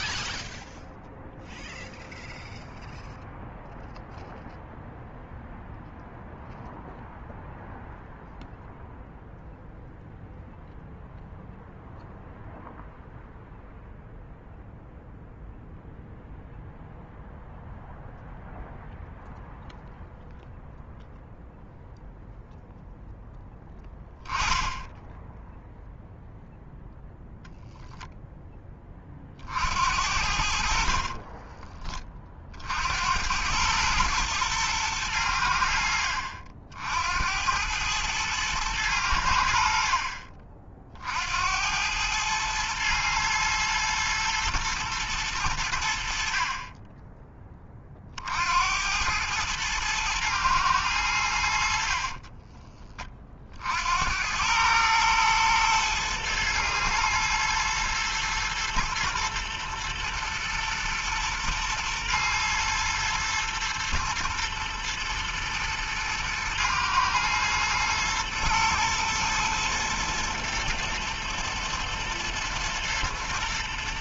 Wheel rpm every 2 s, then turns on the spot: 0, 0, 0, 0, 0, 0, 0, 0, 0, 0, 0, 0, 10, 0, 40, 40, 90, 100, 70, 90, 70, 110, 110, 20, 100, 90, 40, 110, 110, 110, 120, 120, 120, 120, 110, 110, 120.
30-32